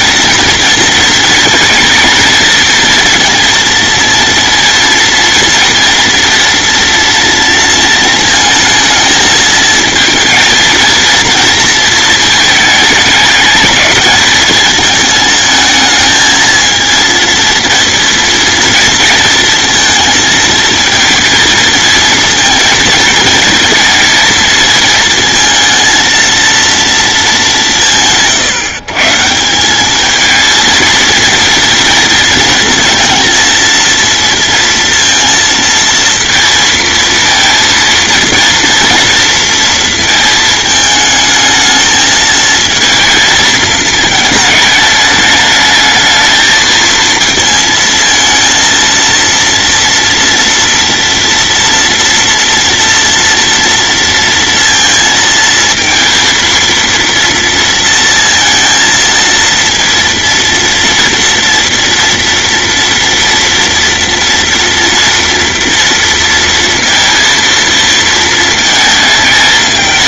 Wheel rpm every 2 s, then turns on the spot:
230, 230, 230, 230, 220, 230, 210, 220, 230, 230, 230, 220, 220, 220, 150, 230, 230, 230, 230, 230, 220, 230, 210, 220, 230, 230, 230, 230, 230, 230, 230, 230, 230, 230, 220.
none